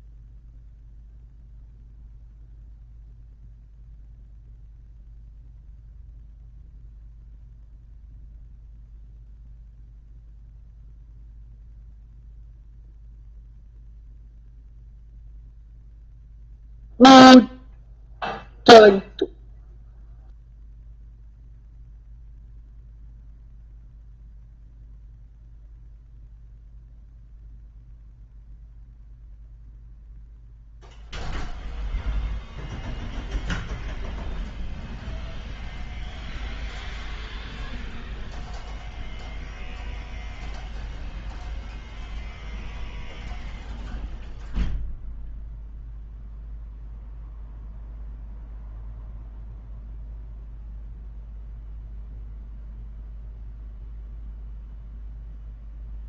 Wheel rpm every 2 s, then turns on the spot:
0, 0, 0, 0, 0, 0, 0, 0, 0, 0, 0, 0, 0, 0, 0, 0, 0, 0, 0, 0, 0, 0, 0, 0, 0, 0, 0, 0.
none